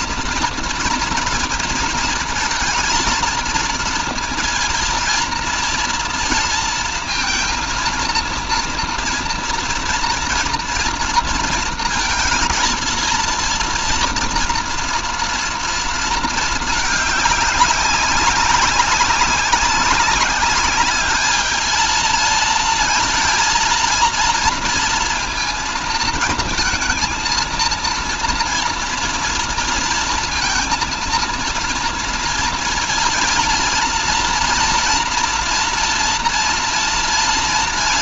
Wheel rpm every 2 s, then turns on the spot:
230, 230, 230, 230, 230, 230, 230, 230, 220, 190, 200, 230, 230, 230, 230, 230, 230, 230, 230.
none